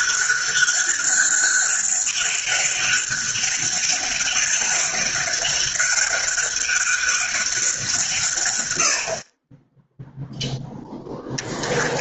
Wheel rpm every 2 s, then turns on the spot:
200, 200, 200, 200, 70, 0.
none